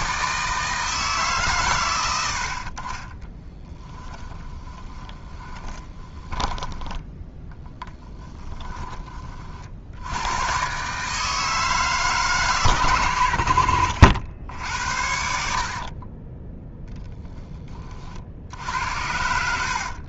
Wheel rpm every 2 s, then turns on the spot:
160, 40, 20, 10, 20, 130, 110, 70, 10, 70.
4-8